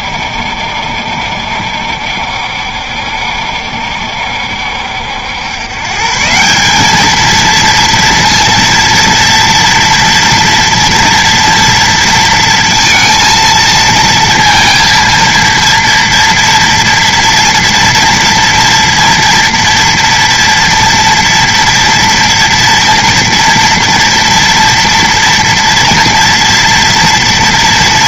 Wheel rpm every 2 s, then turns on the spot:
70, 70, 70, 190, 230, 230, 230, 230, 240, 230, 230, 230, 240, 230.
none